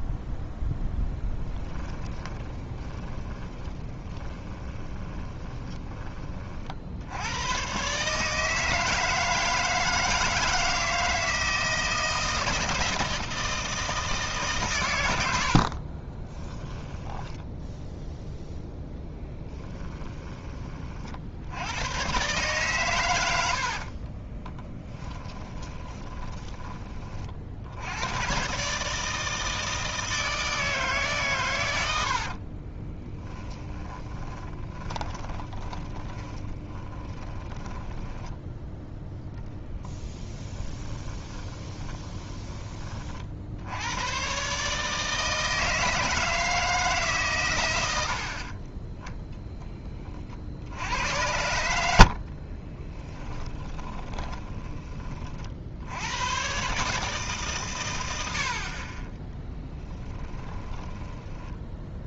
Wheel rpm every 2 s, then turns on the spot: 0, 20, 20, 60, 160, 160, 160, 120, 10, 0, 30, 120, 20, 20, 140, 150, 30, 20, 20, 0, 20, 30, 150, 150, 20, 60, 30, 20, 140, 40, 10.
2-6 16-18 24-26 32-38 40-42 52-54 60-62